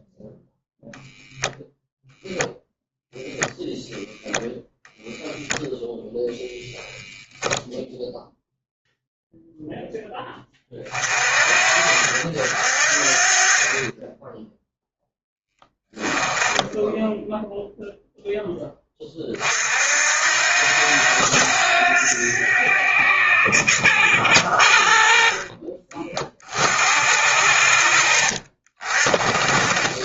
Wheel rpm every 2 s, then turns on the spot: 0, 0, 0, 0, 0, 40, 40, 0, 0, 30, 90, 80, 60, 70, 40.
26-28